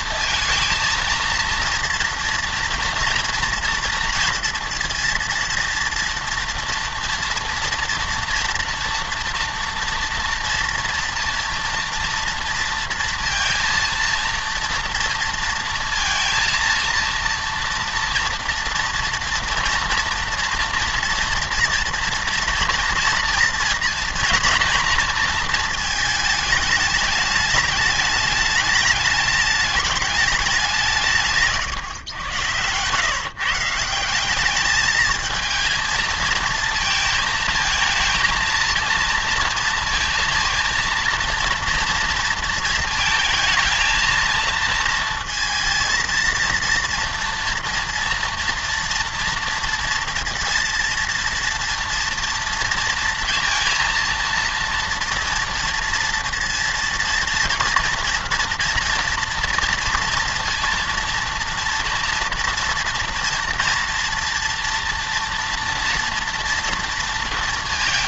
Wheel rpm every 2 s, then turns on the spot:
230, 230, 230, 230, 230, 230, 230, 230, 230, 230, 230, 230, 230, 210, 210, 180, 110, 210, 230, 230, 230, 230, 230, 230, 230, 230, 230, 230, 230, 230, 230, 230, 230, 230.
none